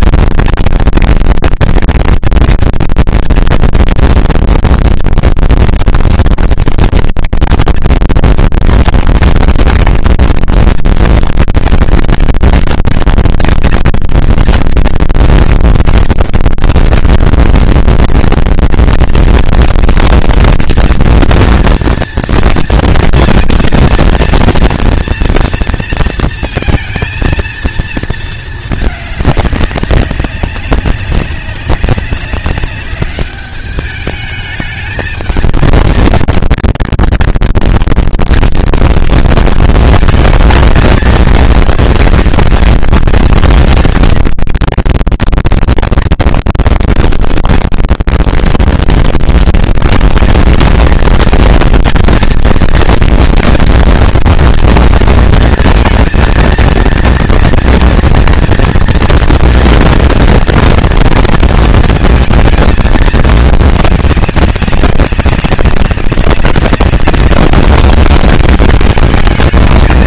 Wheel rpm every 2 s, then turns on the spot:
220, 230, 230, 230, 230, 230, 220, 230, 170, 230, 230, 230, 230, 230, 220, 200, 200, 220, 230, 210, 220, 230, 220, 200, 220, 230, 230, 230, 230, 230, 230, 230, 200, 200, 210.
none